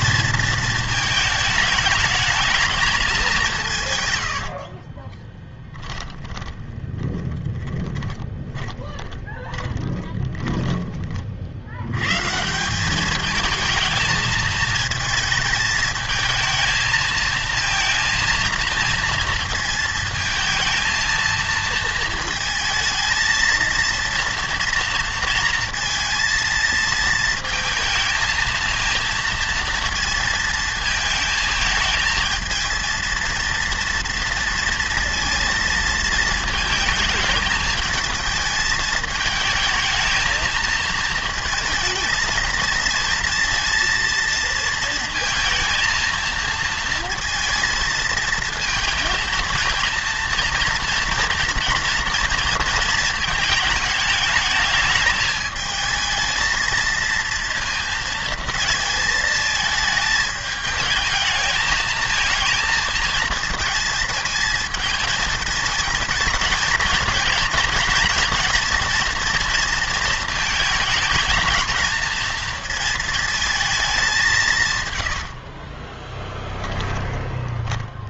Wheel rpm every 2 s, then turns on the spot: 220, 220, 50, 20, 20, 20, 170, 220, 220, 230, 230, 220, 230, 230, 230, 220, 220, 230, 220, 220, 230, 220, 230, 230, 220, 230, 230, 220, 230, 230, 220, 230, 220, 220, 230, 220, 220, 150, 10.
4-12